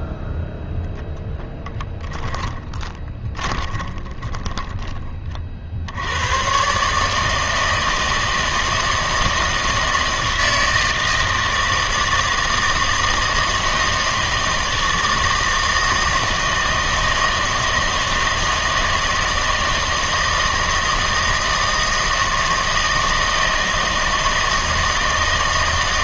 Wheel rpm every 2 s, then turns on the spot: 10, 20, 10, 120, 160, 160, 160, 160, 160, 160, 160, 160, 160.
0-6